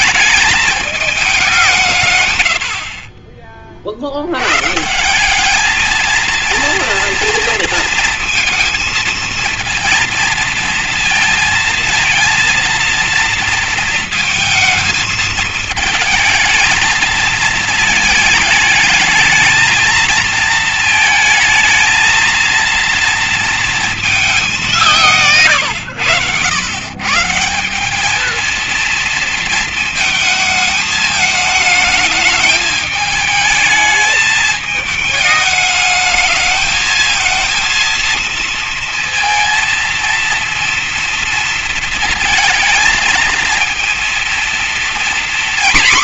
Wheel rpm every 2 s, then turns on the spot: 210, 50, 160, 230, 230, 230, 230, 220, 220, 210, 230, 230, 160, 130, 230, 220, 220, 220, 220, 230, 230, 220, 240.
none